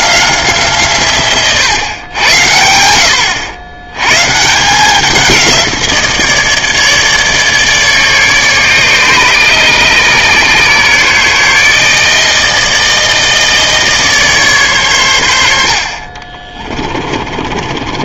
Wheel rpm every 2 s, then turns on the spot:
160, 90, 160, 160, 150, 140, 160, 140, 30.
16-18